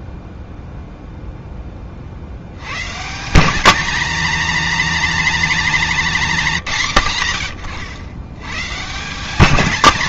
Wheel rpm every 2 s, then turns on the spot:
0, 100, 240, 170, 120.
none